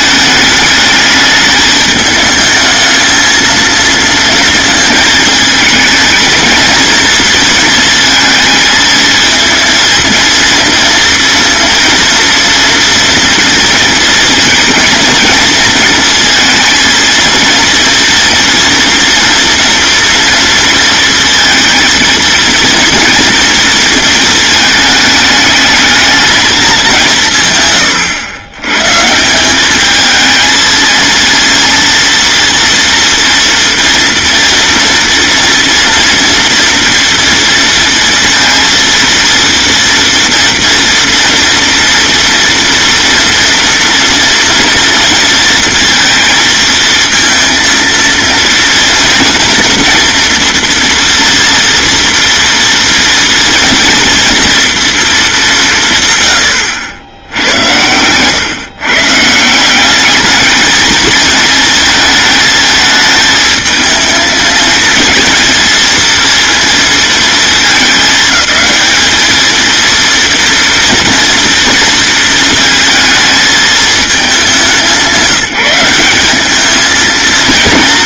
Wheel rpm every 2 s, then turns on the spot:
210, 220, 220, 220, 220, 230, 240, 230, 230, 230, 230, 230, 210, 190, 140, 230, 230, 230, 230, 230, 230, 230, 230, 230, 230, 240, 230, 230, 90, 140, 220, 220, 220, 230, 220, 230, 220, 180, 220.
none